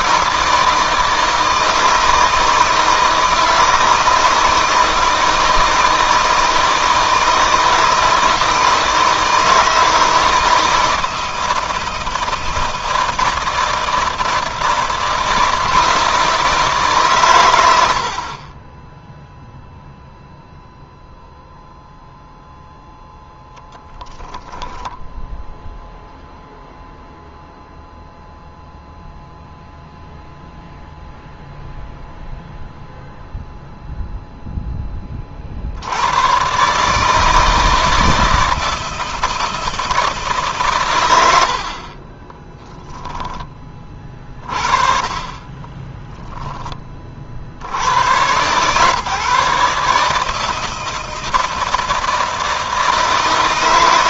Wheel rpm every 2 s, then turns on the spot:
160, 160, 160, 160, 160, 160, 160, 160, 140, 10, 0, 0, 0, 0, 0, 0, 0, 20, 150, 160, 130, 10, 30, 20, 130, 160, 160.
42-44